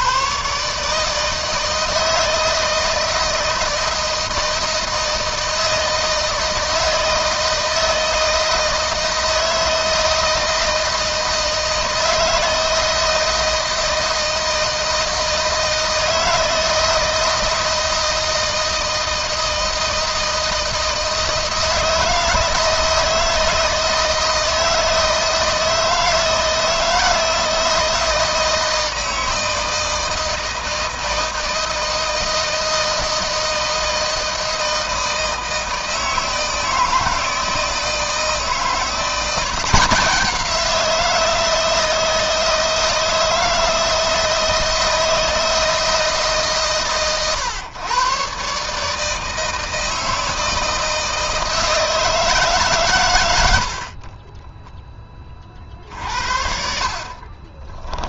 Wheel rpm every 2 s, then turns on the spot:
150, 160, 160, 160, 160, 160, 160, 160, 160, 160, 160, 160, 160, 160, 160, 160, 160, 160, 160, 170, 170, 160, 160, 130, 150, 160, 120, 20, 40.
56-58